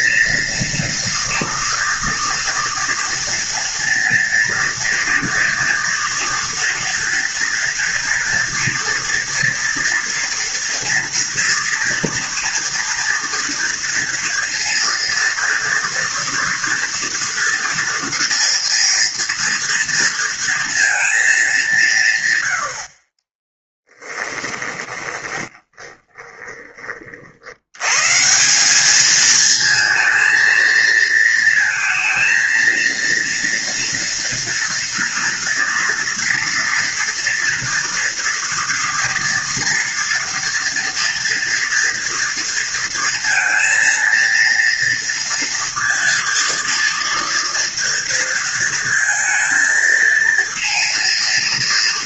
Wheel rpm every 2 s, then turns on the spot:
230, 230, 230, 230, 230, 230, 230, 230, 230, 240, 230, 60, 10, 40, 210, 220, 230, 230, 230, 230, 230, 230, 230, 230, 230, 230.
24-26